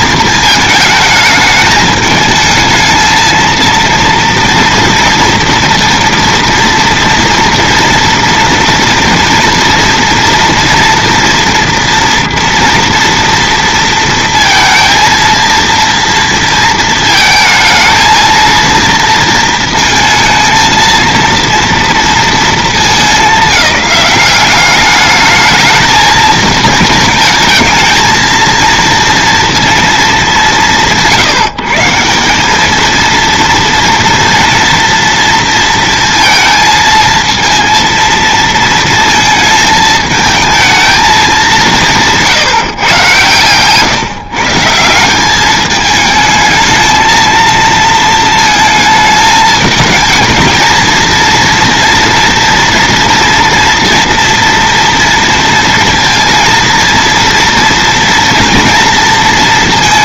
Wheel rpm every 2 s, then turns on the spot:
220, 220, 230, 230, 230, 240, 230, 230, 230, 230, 230, 220, 200, 230, 230, 190, 200, 230, 230, 230, 220, 160, 150, 220, 220, 220, 230, 230, 230, 230.
none